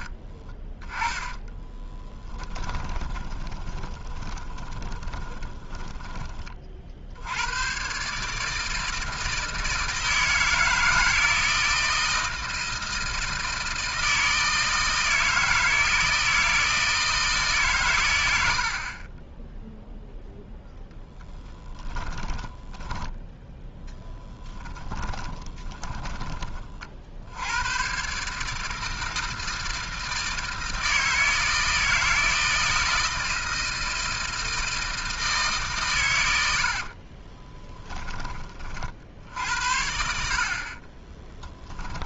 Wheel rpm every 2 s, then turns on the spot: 10, 10, 20, 50, 160, 160, 160, 160, 160, 60, 0, 10, 10, 30, 150, 160, 160, 160, 70, 40, 50.
0-6 22-26 36-38